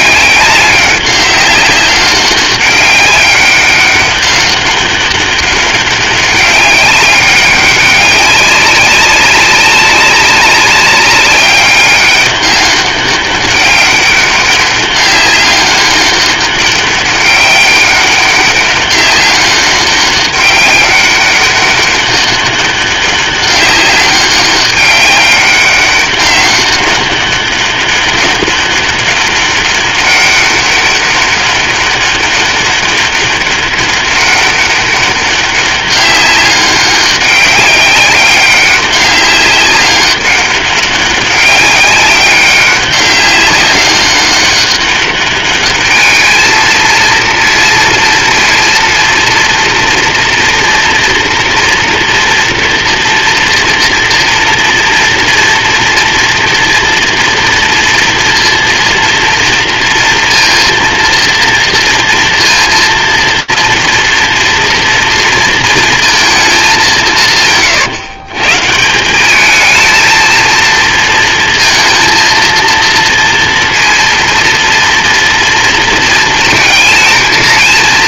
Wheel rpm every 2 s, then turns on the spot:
200, 200, 200, 200, 190, 190, 200, 200, 200, 200, 200, 200, 200, 200, 200, 200, 200, 200, 200, 200, 200, 200, 200, 230, 230, 230, 230, 230, 230, 230, 230, 230, 230, 190, 180, 230, 230, 230, 230.
none